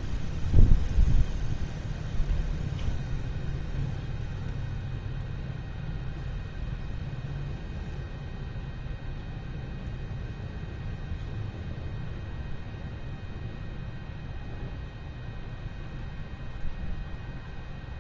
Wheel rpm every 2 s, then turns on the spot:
0, 0, 0, 0, 0, 0, 0, 0, 0.
none